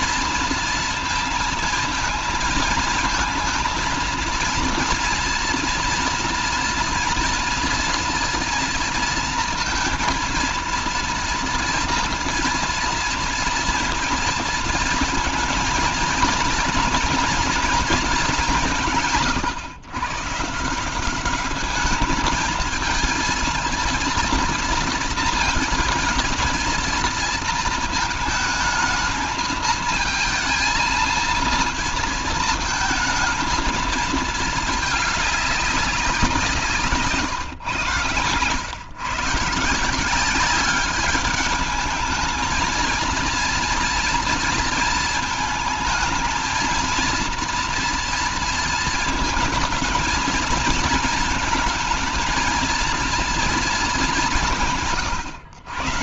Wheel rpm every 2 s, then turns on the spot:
230, 220, 230, 230, 230, 230, 230, 230, 230, 180, 150, 220, 230, 220, 220, 220, 220, 220, 160, 110, 200, 230, 230, 220, 230, 220, 230, 170.
36-38